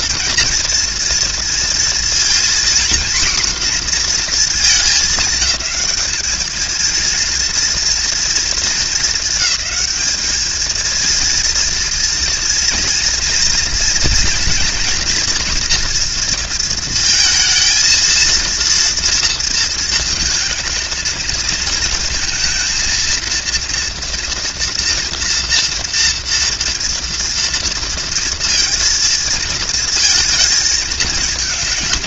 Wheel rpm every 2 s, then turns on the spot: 230, 240, 230, 230, 220, 220, 230, 240, 230, 230, 220, 230, 230, 230, 230, 220.
none